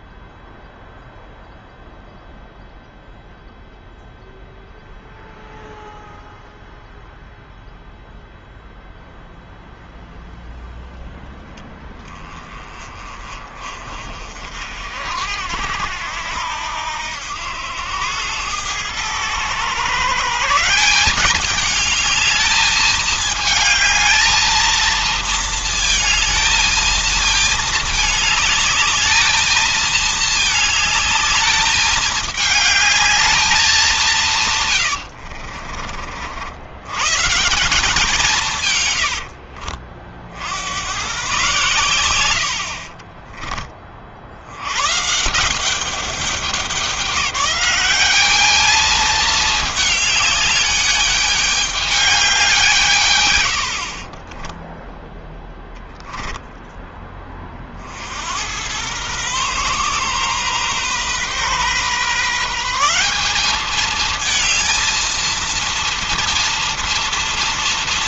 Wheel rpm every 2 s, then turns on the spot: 0, 0, 0, 0, 0, 0, 20, 50, 80, 100, 150, 210, 220, 220, 220, 220, 220, 140, 70, 160, 70, 70, 80, 190, 210, 210, 180, 20, 10, 80, 130, 150, 220, 230.
34-36 54-56